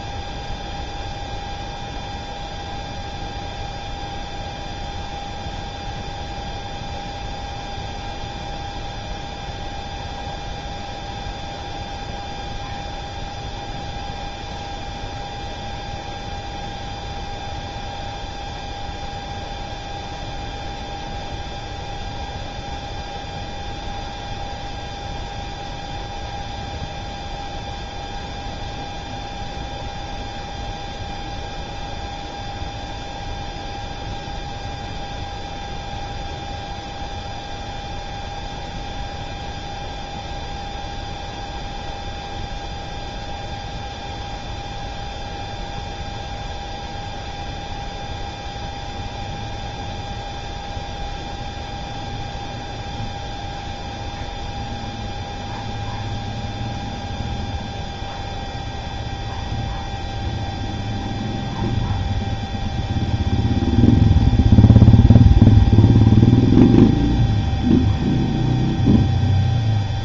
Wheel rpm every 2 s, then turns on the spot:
0, 0, 0, 0, 0, 0, 0, 0, 0, 0, 0, 0, 0, 0, 0, 0, 0, 0, 0, 0, 0, 0, 0, 0, 0, 0, 0, 0, 0, 0, 0, 0, 0, 0, 0.
none